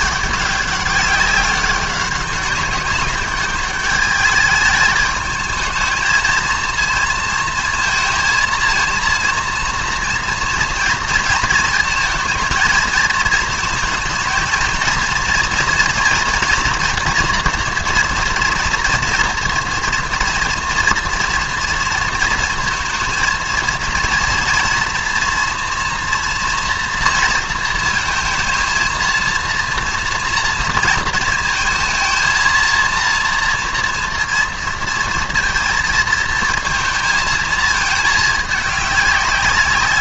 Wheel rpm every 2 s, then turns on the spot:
200, 200, 210, 230, 230, 230, 220, 220, 230, 230, 230, 220, 230, 230, 230, 230, 230, 230, 220, 210.
none